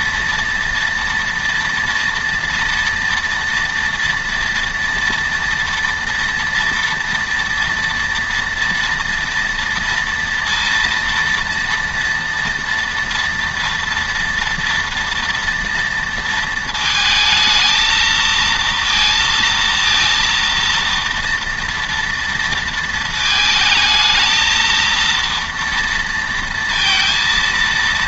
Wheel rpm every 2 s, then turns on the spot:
230, 230, 230, 230, 230, 230, 230, 230, 230, 230, 230, 230, 220, 230.
none